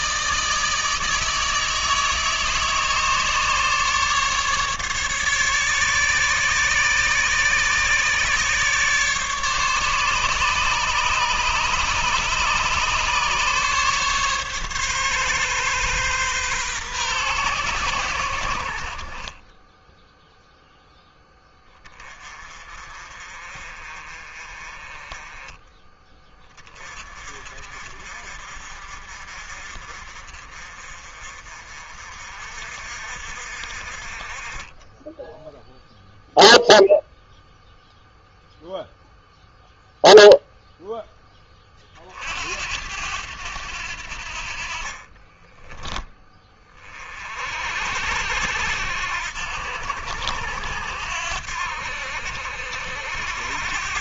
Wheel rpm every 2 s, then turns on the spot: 160, 160, 150, 140, 150, 140, 140, 140, 130, 70, 0, 40, 30, 30, 50, 40, 50, 30, 0, 0, 0, 70, 50, 30, 80, 80, 70.
44-46